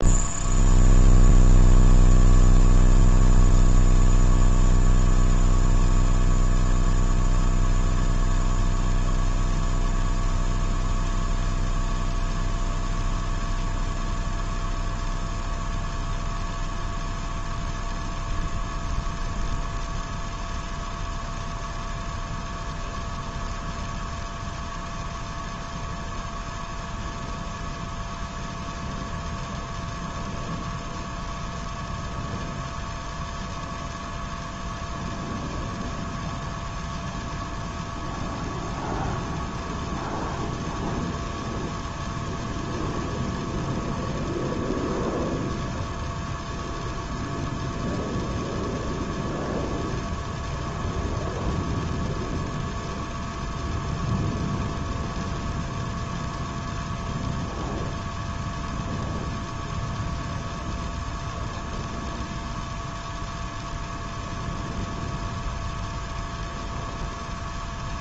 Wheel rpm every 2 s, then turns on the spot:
0, 0, 0, 0, 0, 0, 0, 0, 0, 0, 0, 0, 0, 0, 0, 0, 0, 0, 0, 0, 0, 0, 0, 0, 0, 0, 0, 0, 0, 0, 0, 0, 0, 0.
none